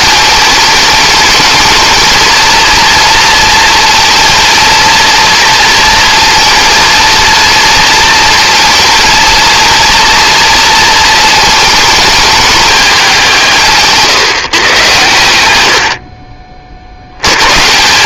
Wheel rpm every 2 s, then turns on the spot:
210, 230, 230, 230, 230, 230, 210, 120, 50.
none